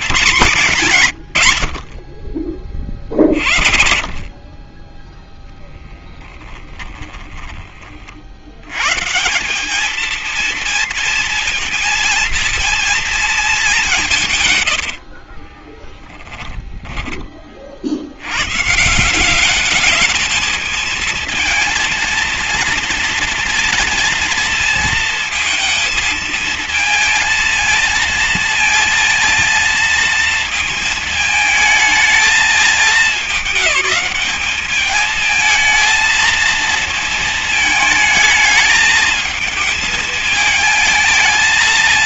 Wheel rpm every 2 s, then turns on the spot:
120, 50, 30, 10, 110, 230, 230, 90, 10, 140, 220, 230, 230, 230, 230, 220, 210, 220, 220, 220, 220.
6-8 14-18